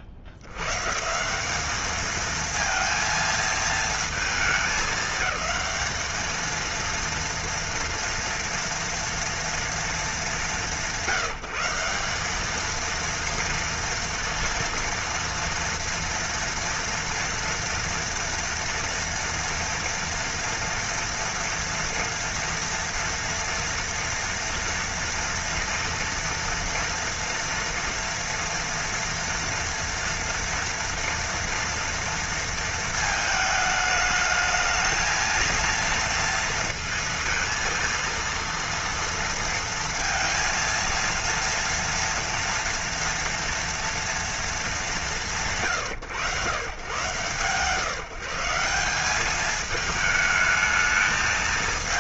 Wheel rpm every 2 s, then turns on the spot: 120, 230, 220, 230, 230, 170, 220, 230, 230, 230, 230, 230, 240, 240, 230, 230, 230, 220, 230, 230, 230, 230, 230, 100, 180, 200.
none